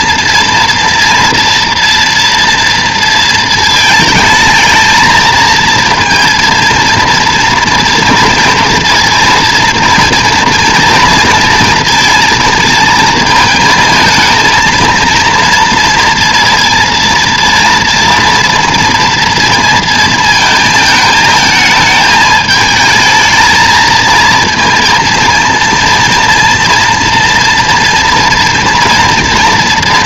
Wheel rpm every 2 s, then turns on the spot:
230, 230, 220, 230, 230, 230, 220, 230, 230, 230, 220, 220, 230, 230, 230.
none